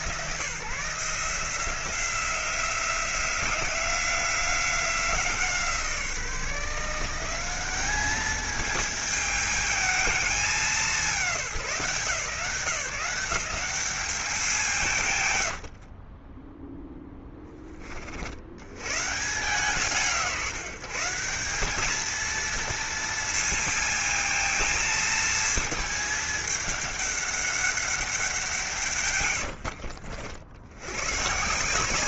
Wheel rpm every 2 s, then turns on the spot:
160, 180, 180, 170, 220, 190, 170, 150, 10, 130, 150, 230, 220, 200, 150, 100.
none